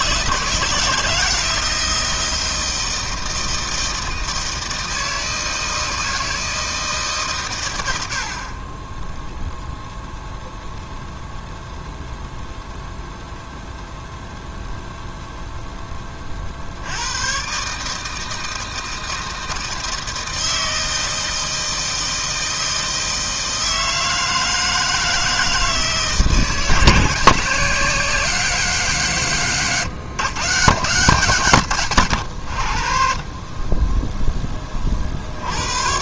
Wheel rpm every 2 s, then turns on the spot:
160, 160, 160, 160, 50, 0, 0, 0, 40, 160, 160, 160, 160, 170, 190, 160, 90, 20.
none